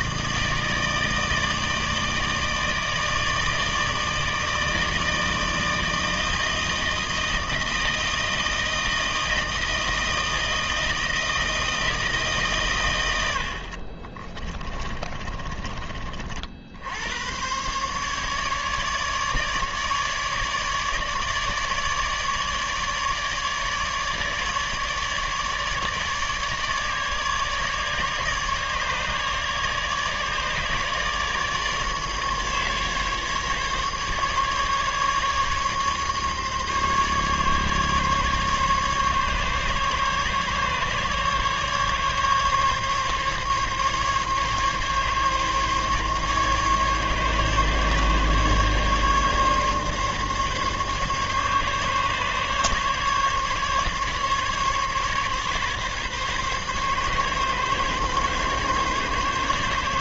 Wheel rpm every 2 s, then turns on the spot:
160, 160, 160, 160, 160, 160, 140, 30, 70, 150, 150, 150, 150, 150, 150, 150, 150, 140, 140, 140, 140, 140, 140, 140, 140, 140, 140, 140, 140, 140.
14-16